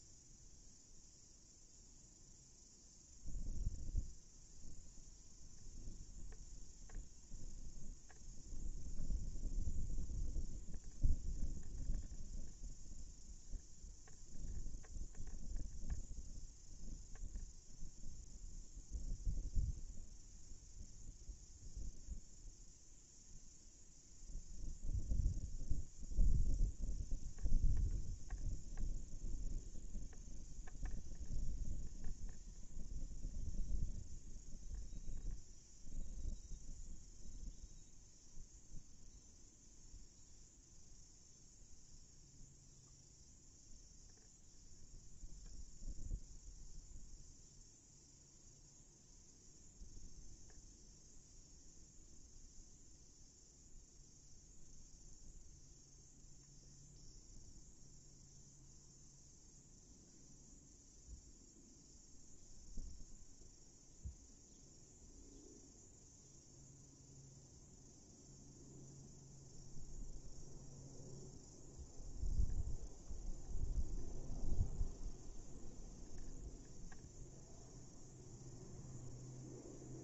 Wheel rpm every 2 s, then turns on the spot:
0, 0, 0, 0, 0, 0, 0, 0, 0, 0, 0, 0, 0, 0, 0, 0, 0, 0, 0, 0, 0, 0, 0, 0, 0, 0, 0, 0, 0, 0, 0, 0, 0, 0, 0, 0, 0, 0, 0, 0.
none